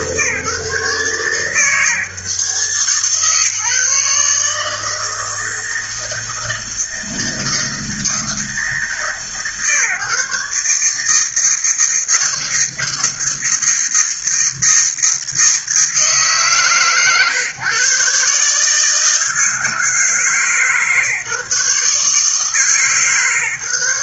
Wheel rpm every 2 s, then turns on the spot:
150, 140, 160, 160, 150, 150, 160, 160, 140, 160, 160, 150.
none